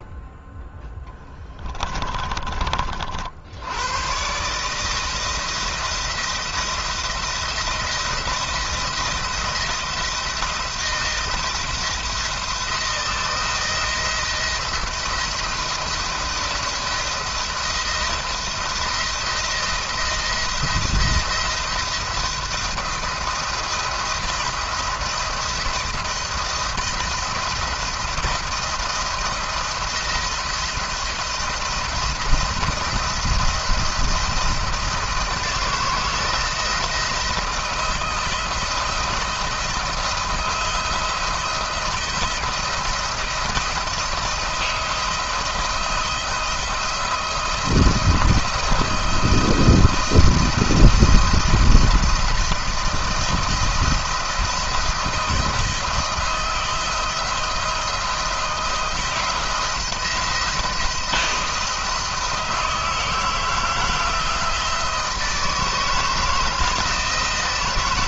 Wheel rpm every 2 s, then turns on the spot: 0, 50, 160, 170, 170, 160, 170, 170, 170, 170, 170, 170, 170, 170, 170, 170, 170, 170, 160, 170, 170, 170, 170, 170, 170, 170, 160, 170, 160, 170, 170, 160, 160, 160.
none